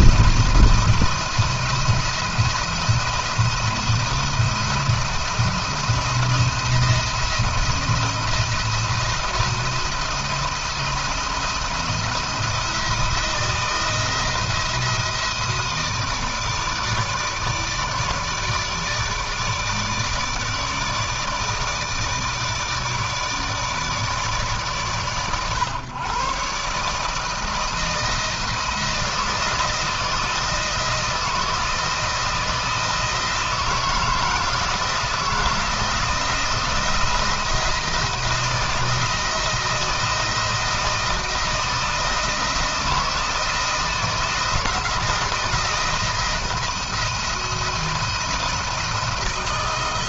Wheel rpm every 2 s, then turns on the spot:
170, 170, 170, 170, 170, 170, 170, 160, 150, 150, 160, 160, 140, 140, 170, 170, 160, 160, 170, 160, 160, 170, 170, 170, 170.
none